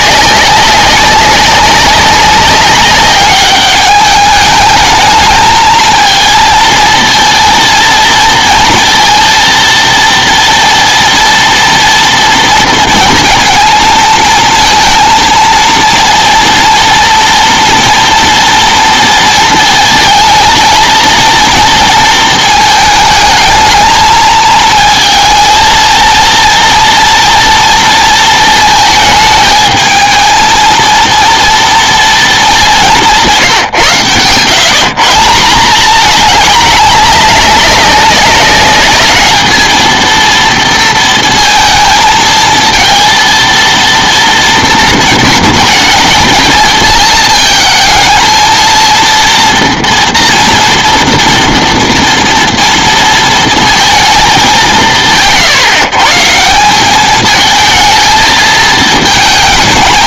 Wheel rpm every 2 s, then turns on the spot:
190, 190, 210, 230, 230, 240, 230, 230, 230, 230, 230, 220, 220, 230, 220, 220, 200, 140, 210, 200, 230, 230, 230, 220, 230, 240, 230, 190, 180, 220.
none